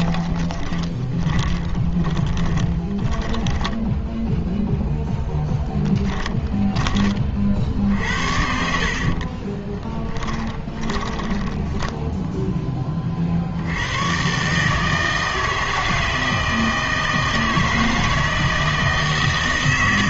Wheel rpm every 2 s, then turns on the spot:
20, 10, 0, 20, 70, 10, 10, 140, 160, 160.
0-4 6-12